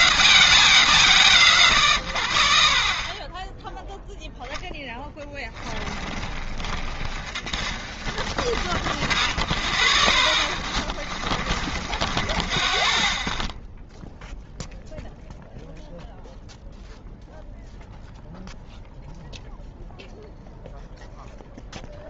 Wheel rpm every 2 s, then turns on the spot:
0, 10, 10, 40, 30, 20, 10, 0, 0, 0, 0.
4-14